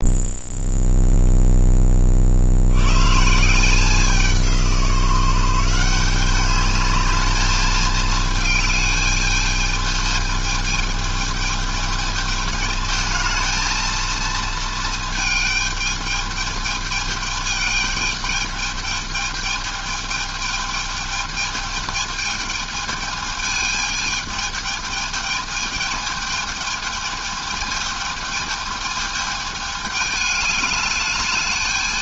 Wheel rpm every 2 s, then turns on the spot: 0, 130, 170, 210, 210, 220, 220, 220, 220, 220, 220, 220, 220, 210, 220, 210.
none